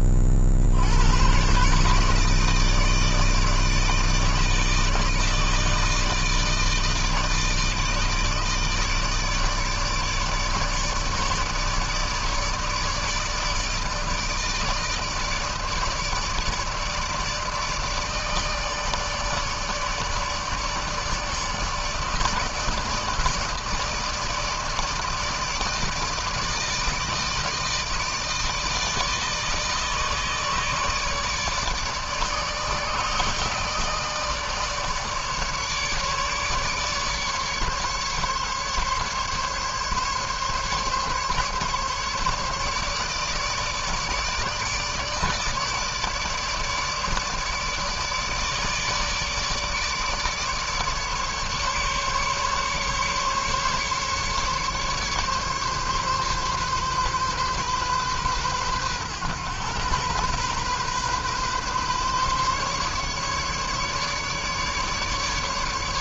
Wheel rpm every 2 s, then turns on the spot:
50, 150, 160, 160, 150, 150, 160, 160, 150, 150, 150, 150, 160, 160, 160, 150, 150, 150, 150, 140, 140, 150, 150, 150, 150, 150, 140, 140, 140, 120, 130, 140, 150.
none